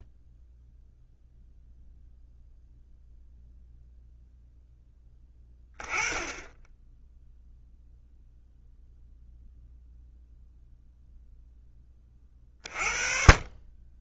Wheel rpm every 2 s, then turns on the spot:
0, 0, 0, 10, 0, 0, 40.
none